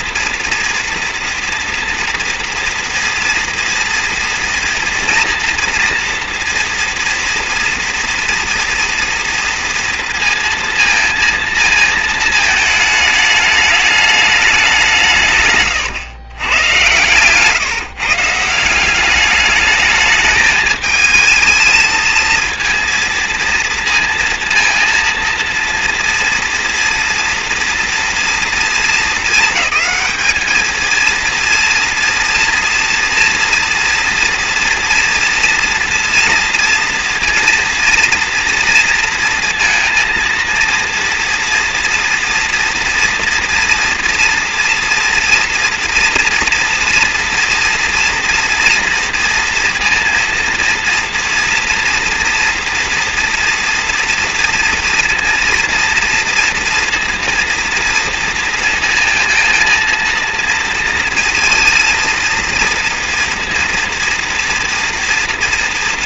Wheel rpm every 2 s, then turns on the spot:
230, 240, 230, 240, 230, 230, 220, 210, 120, 160, 210, 230, 230, 230, 230, 220, 230, 240, 230, 230, 230, 240, 230, 230, 230, 230, 230, 230, 230, 230, 230, 230, 230.
none